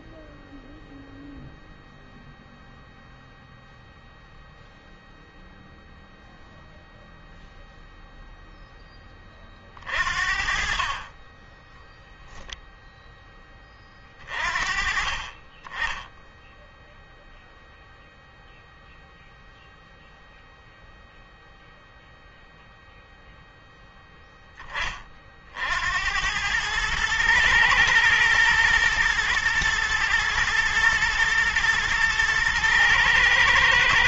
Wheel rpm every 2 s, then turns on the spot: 0, 0, 0, 0, 20, 30, 10, 30, 0, 0, 0, 0, 40, 110, 110, 120, 120.
none